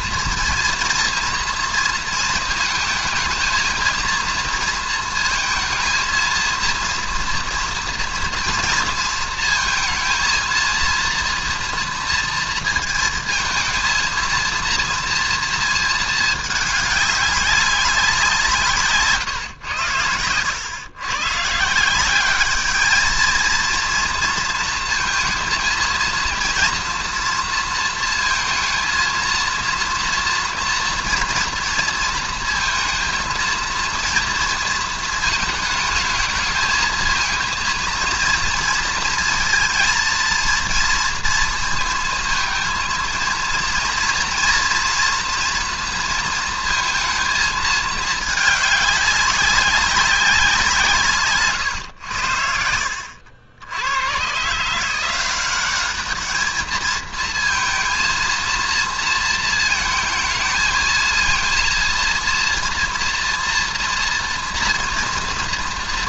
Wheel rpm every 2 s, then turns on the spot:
230, 230, 230, 230, 230, 230, 230, 230, 210, 170, 100, 210, 230, 230, 230, 230, 230, 230, 220, 230, 230, 220, 230, 230, 210, 170, 60, 150, 220, 230, 220, 230, 230.
none